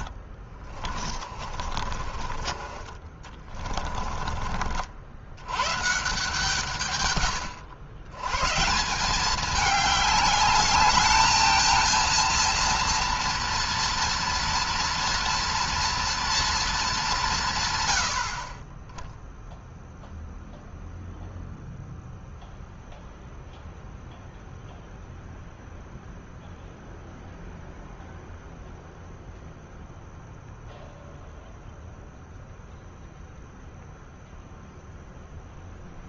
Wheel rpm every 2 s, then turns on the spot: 30, 30, 60, 140, 150, 210, 230, 240, 220, 30, 0, 0, 0, 0, 0, 0, 0, 0.
0-2